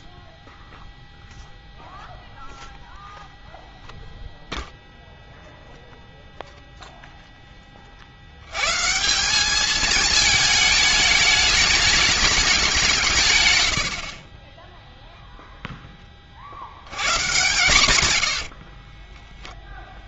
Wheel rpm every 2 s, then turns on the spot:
0, 0, 0, 0, 180, 210, 140, 0, 130, 10.
18-20